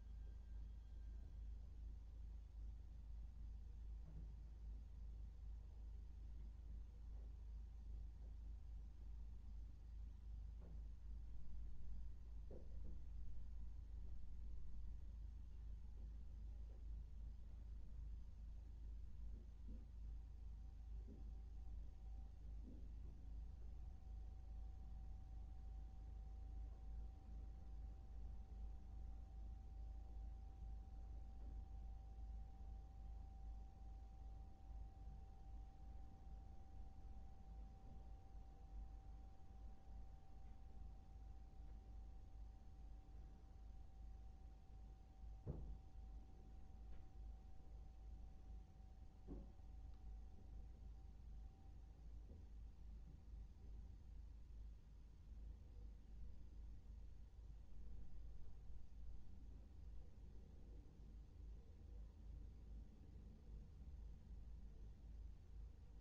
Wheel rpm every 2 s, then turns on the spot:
0, 0, 0, 0, 0, 0, 0, 0, 0, 0, 0, 0, 0, 0, 0, 0, 0, 0, 0, 0, 0, 0, 0, 0, 0, 0, 0, 0, 0, 0, 0, 0, 0.
none